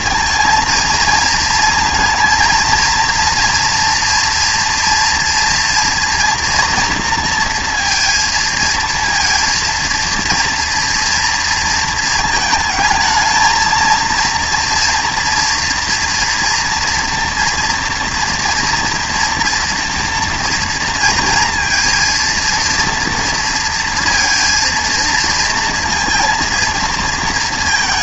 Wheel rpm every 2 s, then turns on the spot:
230, 230, 230, 230, 230, 230, 220, 230, 230, 230, 230, 230, 230, 230.
none